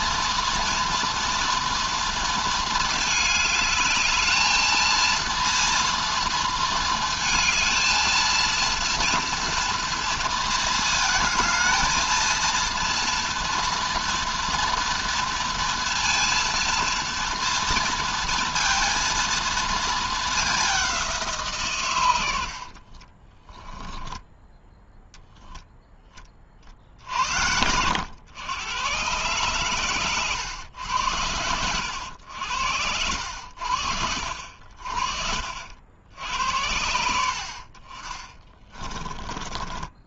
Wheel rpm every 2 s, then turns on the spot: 230, 220, 230, 220, 230, 220, 230, 230, 230, 230, 190, 40, 10, 60, 110, 100, 80, 50, 70, 20.
22-24